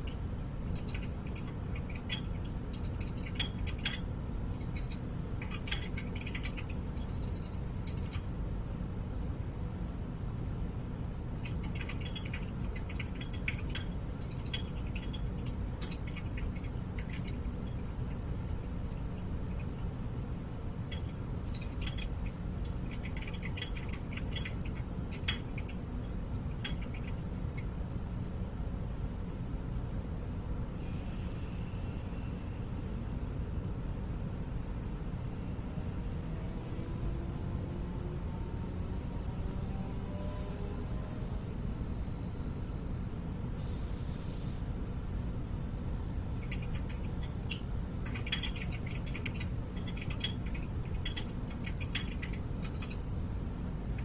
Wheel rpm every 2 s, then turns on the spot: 0, 0, 0, 0, 0, 0, 0, 0, 0, 0, 0, 0, 0, 0, 0, 0, 0, 0, 0, 0, 0, 0, 0, 0, 0, 0, 0.
none